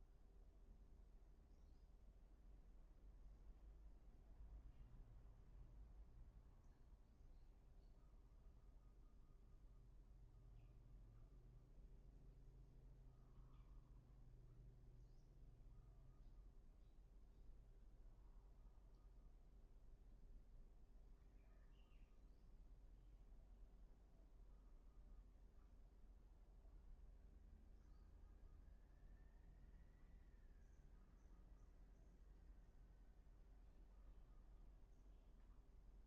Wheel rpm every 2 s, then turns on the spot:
0, 0, 0, 0, 0, 0, 0, 0, 0, 0, 0, 0, 0, 0, 0, 0, 0, 0.
none